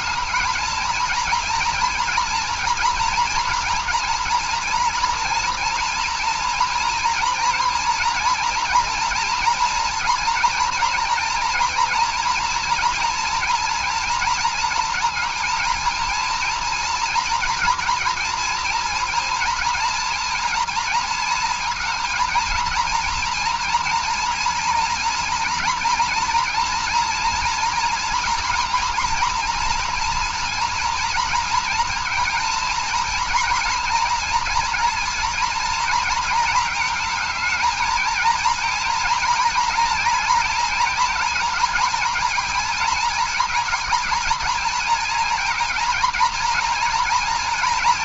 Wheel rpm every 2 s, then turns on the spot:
220, 230, 230, 240, 230, 240, 230, 230, 230, 230, 230, 230, 230, 230, 230, 230, 230, 230, 220, 230, 230, 230, 220, 230.
none